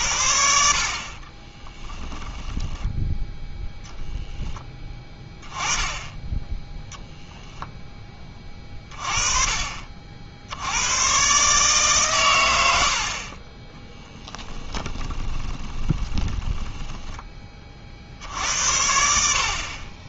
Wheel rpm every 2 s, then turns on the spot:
50, 0, 10, 0, 30, 100, 70, 20, 10, 70.
14-18